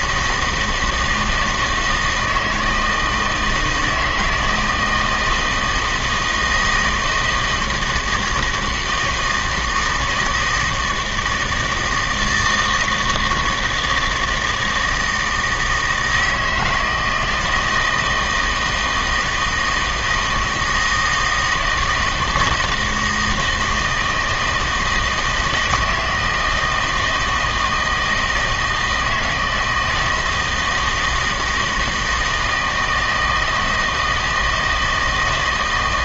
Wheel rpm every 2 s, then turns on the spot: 160, 160, 160, 160, 160, 160, 160, 160, 160, 160, 160, 160, 160, 160, 160, 160, 160, 160.
none